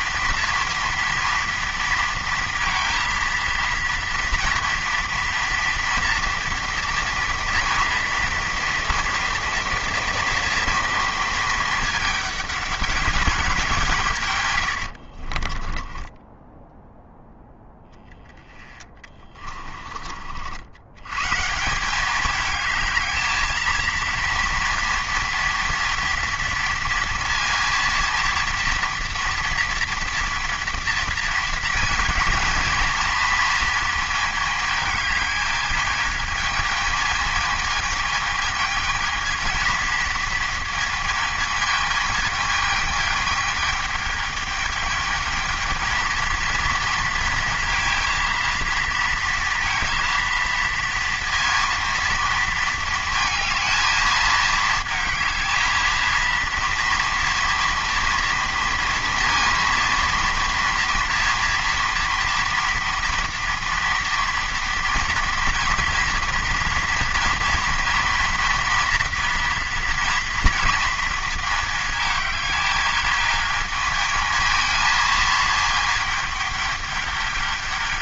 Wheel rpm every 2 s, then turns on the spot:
230, 230, 230, 240, 230, 230, 210, 90, 0, 10, 80, 220, 230, 230, 230, 230, 230, 220, 220, 220, 230, 220, 220, 230, 230, 230, 230, 220, 230, 230, 230, 240, 230, 230, 230, 230, 210, 220, 210.
14-16 18-20